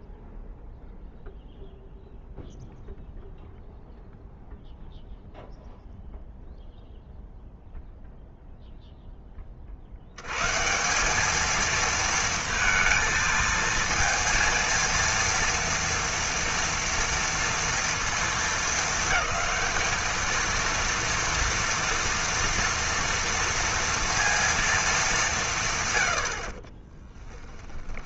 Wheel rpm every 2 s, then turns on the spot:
0, 0, 0, 0, 0, 160, 230, 230, 230, 220, 230, 230, 230, 50.
26-28